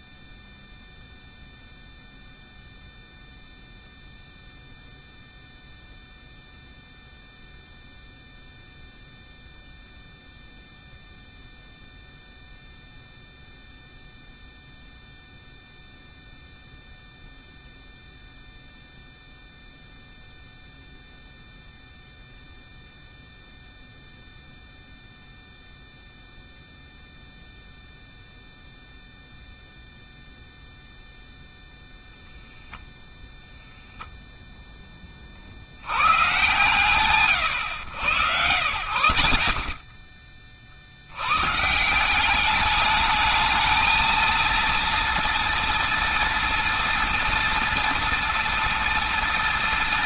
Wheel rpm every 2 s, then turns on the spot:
0, 0, 0, 0, 0, 0, 0, 0, 0, 0, 0, 0, 0, 0, 0, 0, 0, 10, 120, 90, 60, 210, 240, 230, 240.
none